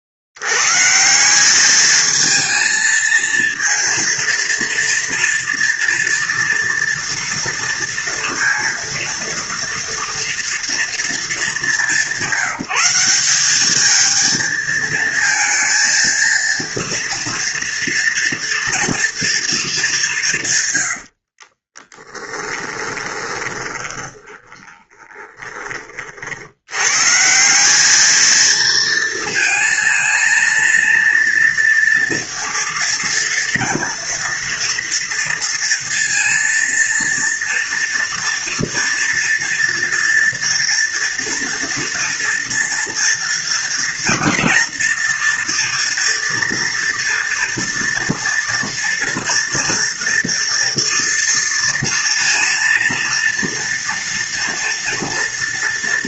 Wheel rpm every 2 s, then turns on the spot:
60, 220, 230, 230, 230, 230, 190, 220, 230, 230, 140, 20, 30, 80, 230, 230, 230, 230, 230, 230, 240, 230, 230, 230, 230, 230, 230, 230.
22-26